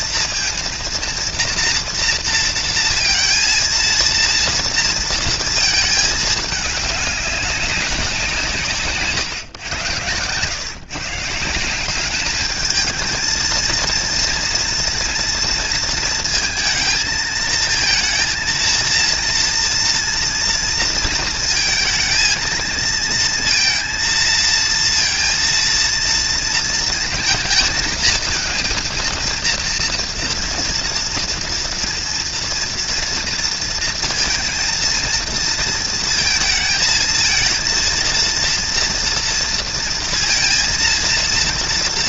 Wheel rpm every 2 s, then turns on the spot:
230, 230, 230, 210, 140, 140, 220, 230, 220, 230, 230, 220, 230, 220, 230, 230, 230, 230, 220, 230, 230.
none